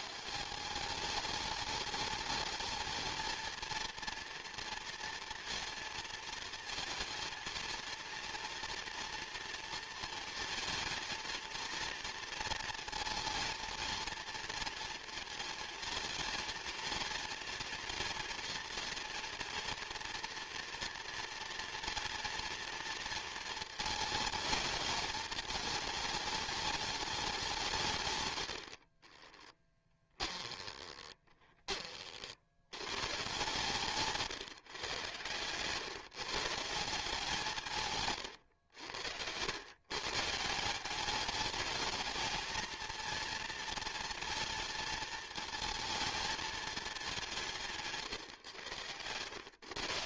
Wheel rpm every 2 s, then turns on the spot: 180, 220, 230, 230, 230, 230, 230, 230, 230, 230, 230, 230, 210, 210, 80, 20, 110, 130, 170, 100, 170, 220, 230, 210, 110.
28-32